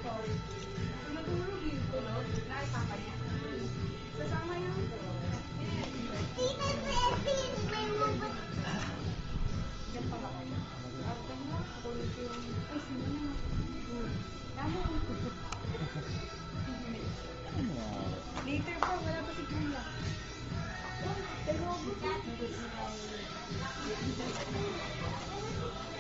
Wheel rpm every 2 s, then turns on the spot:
0, 0, 0, 0, 0, 0, 0, 0, 0, 0, 0, 0, 0.
none